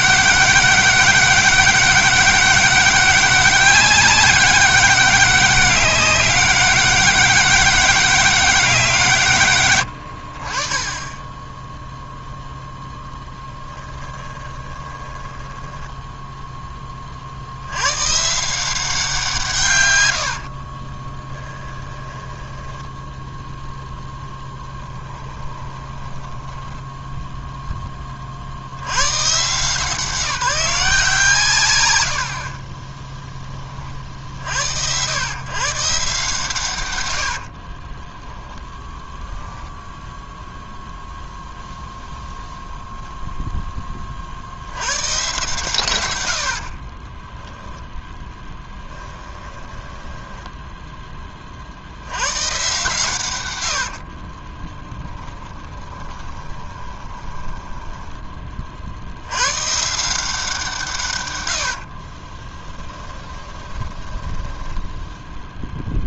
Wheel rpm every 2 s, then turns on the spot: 200, 200, 200, 200, 170, 20, 0, 20, 20, 170, 20, 10, 10, 10, 100, 170, 10, 90, 120, 0, 0, 0, 110, 40, 10, 10, 140, 20, 20, 60, 150, 10, 0.
14-16 20-26 46-50 54-58 62-64